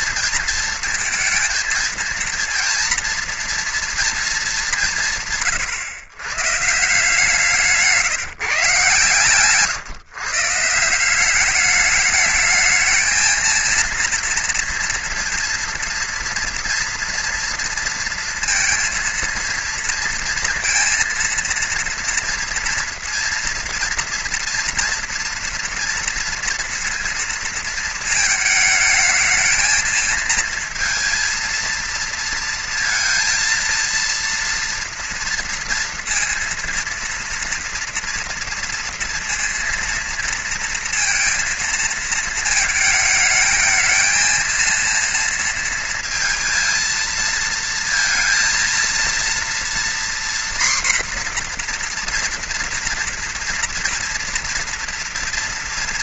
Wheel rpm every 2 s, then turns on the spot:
230, 230, 150, 160, 130, 180, 220, 230, 230, 230, 230, 230, 230, 230, 220, 230, 230, 230, 230, 230, 230, 220, 230, 230, 230, 240, 230, 230.
8-10